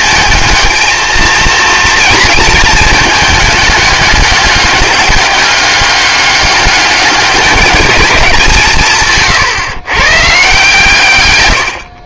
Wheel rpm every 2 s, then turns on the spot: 220, 220, 200, 200, 170, 150.
none